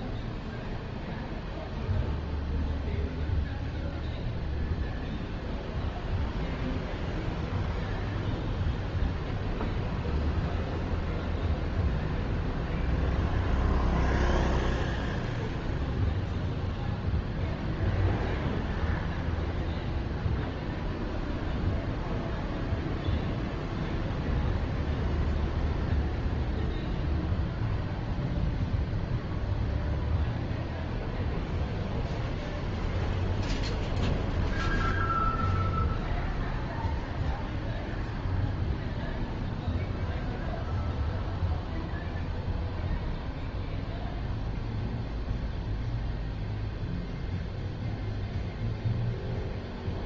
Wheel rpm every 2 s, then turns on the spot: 0, 0, 0, 0, 0, 0, 0, 0, 0, 0, 0, 0, 0, 0, 0, 0, 0, 0, 0, 0, 0, 0, 0, 0, 0.
none